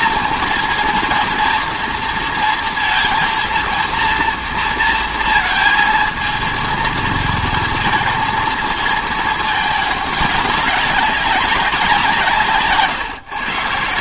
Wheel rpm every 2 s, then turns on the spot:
230, 230, 230, 230, 220, 200, 140.
none